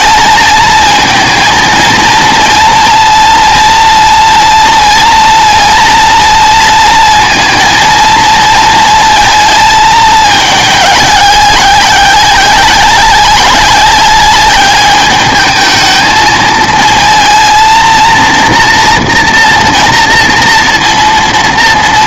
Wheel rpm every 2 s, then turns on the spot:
220, 230, 230, 230, 230, 210, 190, 210, 220, 230, 230.
none